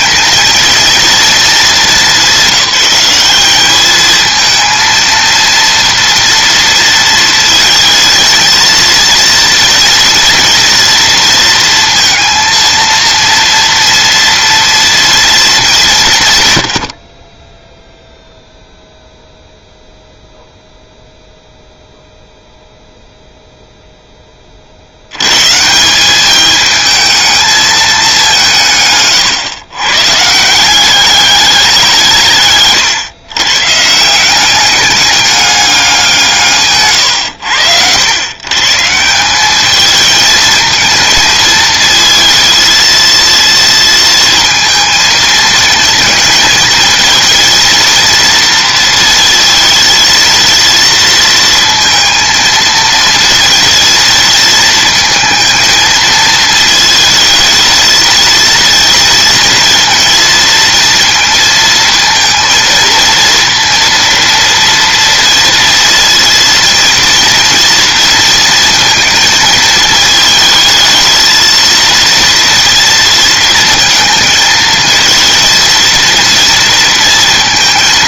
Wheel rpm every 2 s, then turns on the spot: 230, 190, 230, 230, 230, 230, 230, 230, 70, 0, 0, 0, 70, 220, 150, 190, 130, 200, 140, 160, 220, 230, 220, 220, 230, 230, 230, 230, 220, 230, 230, 230, 230, 230, 230, 220, 230, 230, 230.
none